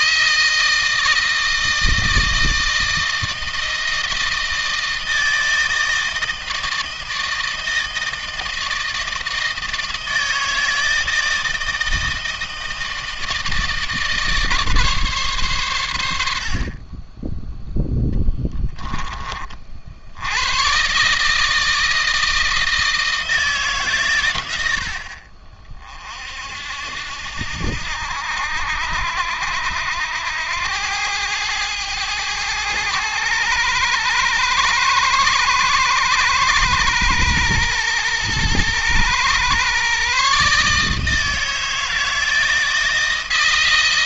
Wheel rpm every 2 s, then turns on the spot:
160, 160, 160, 160, 160, 160, 160, 150, 40, 10, 110, 160, 80, 70, 80, 90, 110, 110, 110, 110, 150, 160.
none